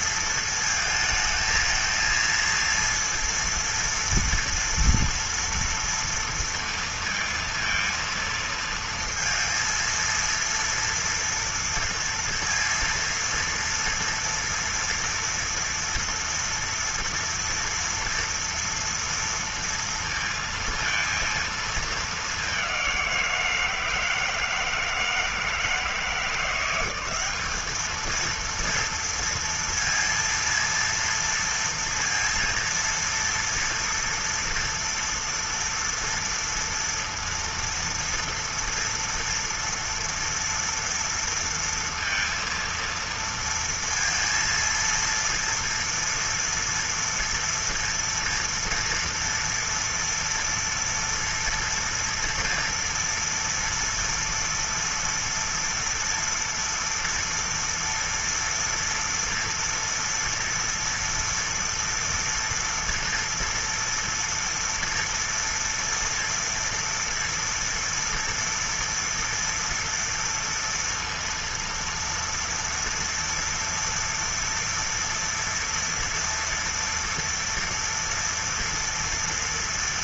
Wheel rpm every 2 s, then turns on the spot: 230, 230, 230, 230, 230, 230, 230, 230, 240, 230, 230, 210, 160, 170, 220, 230, 230, 230, 230, 230, 230, 230, 230, 230, 230, 230, 230, 230, 230, 230, 230, 240, 230, 230, 230, 230, 230, 230, 230, 230.
none